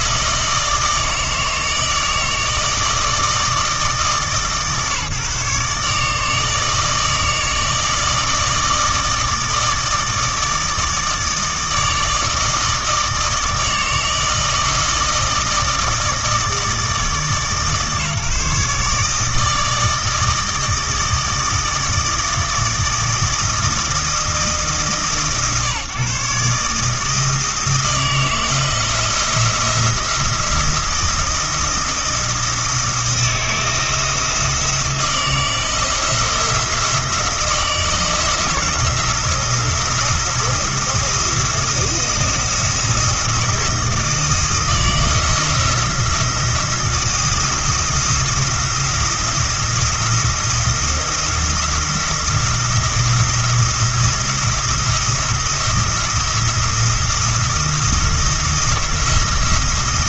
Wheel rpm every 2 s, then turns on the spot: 160, 160, 150, 160, 160, 160, 160, 160, 160, 150, 160, 160, 150, 150, 160, 170, 160, 160, 170, 170, 170, 170, 160, 170, 170, 170, 170, 170, 170, 170.
none